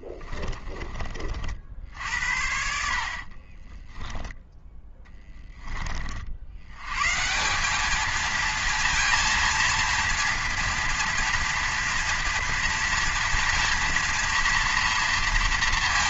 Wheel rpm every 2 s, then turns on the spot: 30, 60, 10, 90, 230, 230, 230, 230.
0-2